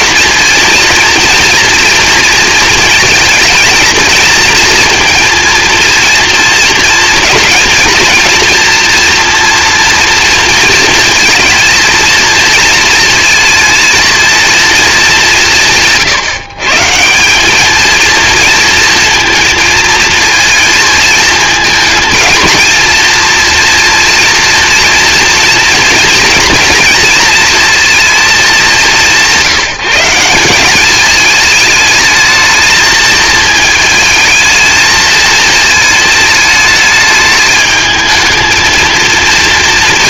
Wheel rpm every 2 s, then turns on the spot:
230, 230, 230, 230, 230, 230, 230, 200, 170, 230, 230, 240, 230, 230, 180, 210, 220, 230, 220, 230.
none